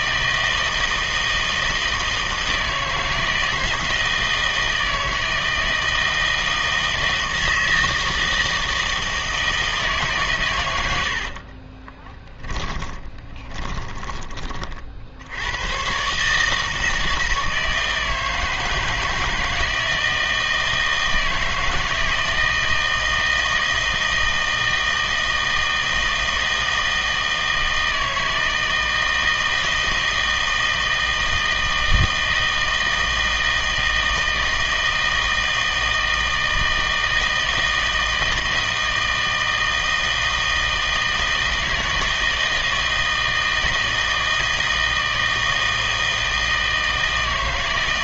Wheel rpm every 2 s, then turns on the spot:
160, 160, 160, 160, 160, 100, 20, 50, 160, 160, 170, 160, 160, 160, 160, 160, 160, 160, 160, 160, 160, 160, 160, 160.
10-14